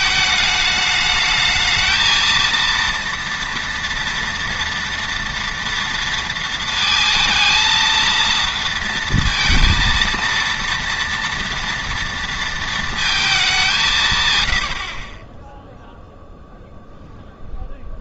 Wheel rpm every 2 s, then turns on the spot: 210, 230, 230, 220, 230, 230, 230, 70, 0.
none